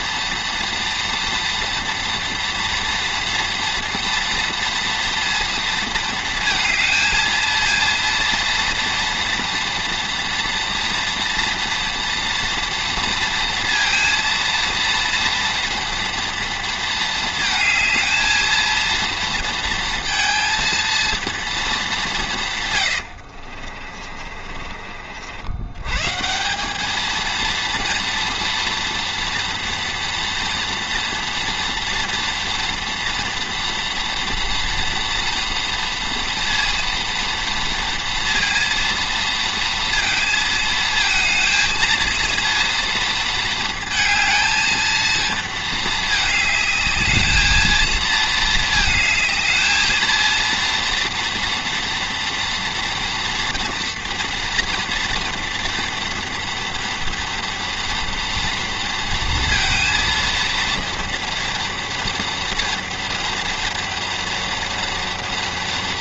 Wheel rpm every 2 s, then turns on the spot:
240, 230, 230, 230, 230, 230, 230, 230, 230, 230, 230, 110, 50, 200, 230, 230, 230, 230, 230, 230, 220, 230, 220, 220, 220, 230, 230, 240, 230, 230, 230, 230, 230.
22-24